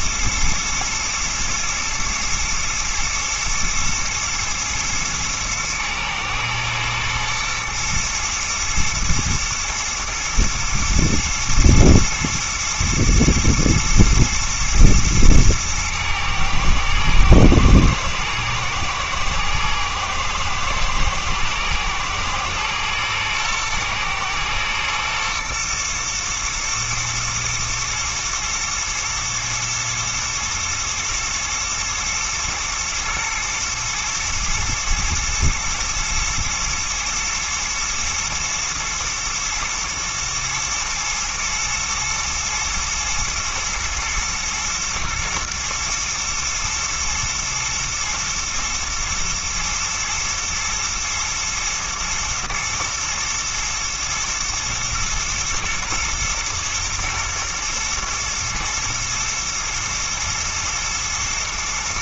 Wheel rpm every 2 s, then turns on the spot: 110, 120, 120, 110, 120, 120, 110, 120, 110, 110, 110, 110, 110, 120, 110, 120, 110, 120, 110, 110, 110, 110, 110, 110, 110, 110, 110, 120, 110, 110, 110.
none